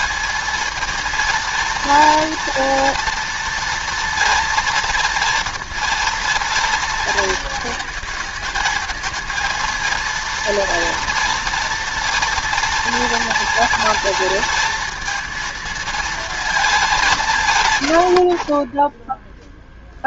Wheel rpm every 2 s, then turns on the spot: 220, 230, 230, 230, 220, 230, 230, 230, 210, 30.
none